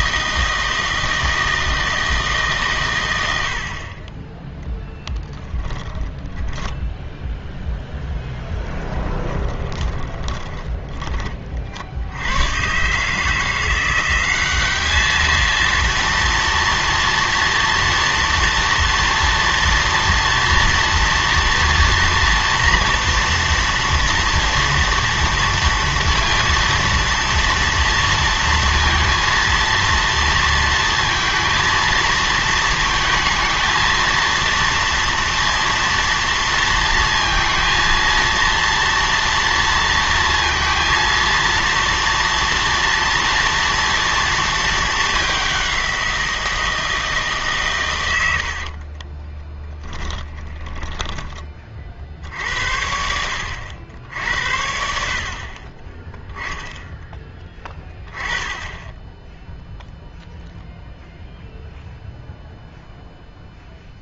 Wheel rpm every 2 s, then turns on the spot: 160, 130, 10, 10, 20, 20, 130, 200, 230, 230, 230, 230, 230, 230, 230, 230, 220, 230, 230, 230, 230, 230, 220, 170, 60, 10, 80, 60, 10, 10, 0, 0.
6-12 48-52